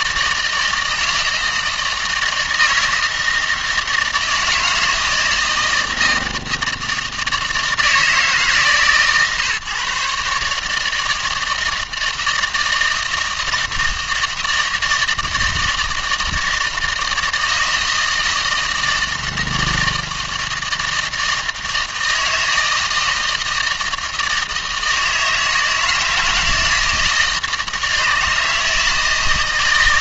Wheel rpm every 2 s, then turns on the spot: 160, 160, 160, 160, 150, 150, 160, 160, 160, 160, 160, 160, 160, 160, 160.
none